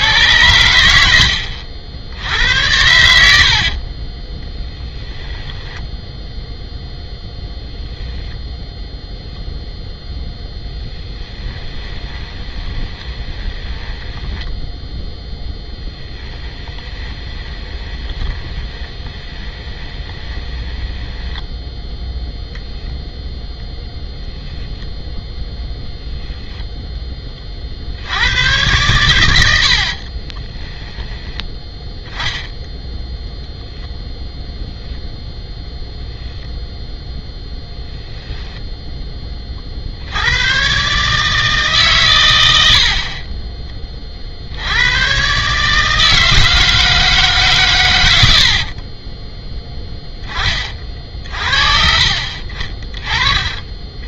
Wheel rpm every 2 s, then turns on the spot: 90, 100, 10, 0, 0, 10, 20, 10, 20, 20, 20, 0, 0, 10, 110, 10, 0, 0, 0, 0, 120, 70, 90, 160, 50, 40, 40.
4-6 12-22 30-32 48-50